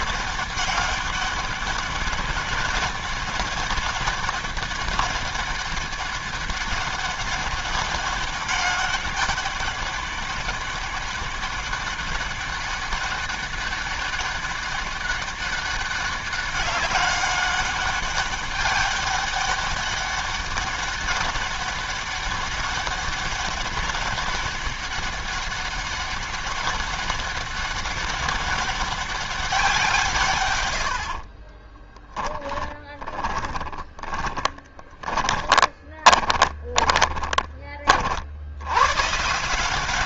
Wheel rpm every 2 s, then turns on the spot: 200, 200, 200, 200, 200, 200, 200, 200, 200, 200, 200, 190, 200, 200, 200, 130, 10, 20, 20, 80.
32-38